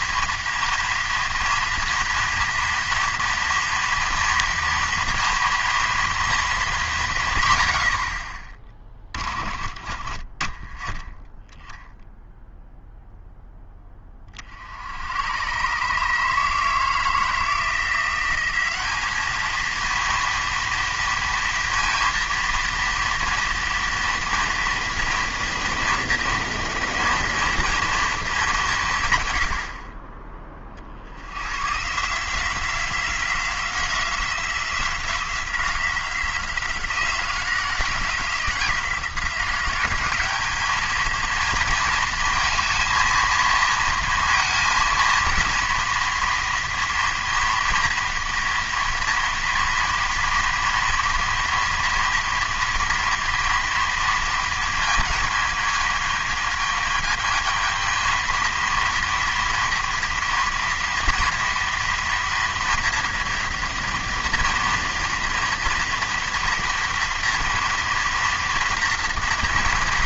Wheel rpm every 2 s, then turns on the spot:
230, 230, 230, 210, 30, 20, 0, 70, 160, 190, 230, 230, 230, 230, 190, 20, 170, 180, 180, 170, 210, 220, 230, 230, 230, 230, 230, 230, 220, 230, 230, 230, 230, 230, 230.
8-10